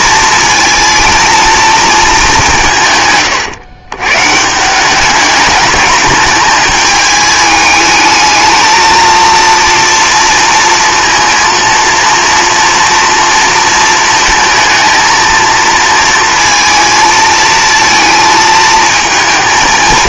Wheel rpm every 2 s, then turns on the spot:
230, 170, 180, 210, 220, 230, 230, 230, 230, 220.
none